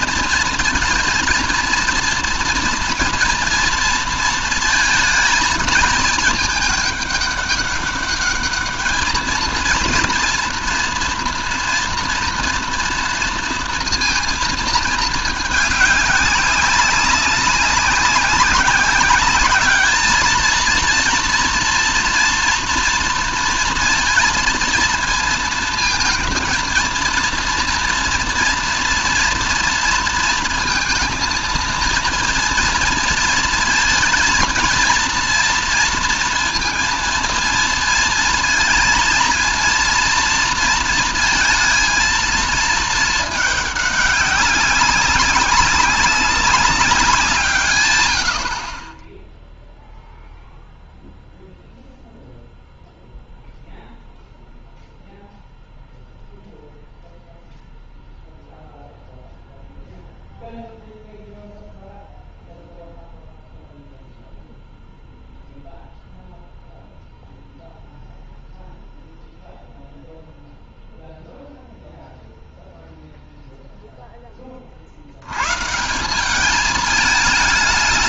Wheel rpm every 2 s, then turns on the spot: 230, 230, 230, 210, 210, 230, 230, 230, 200, 190, 230, 230, 230, 230, 230, 230, 230, 230, 230, 230, 230, 230, 200, 200, 60, 0, 0, 0, 0, 0, 0, 0, 0, 0, 0, 0, 0, 30, 200.
none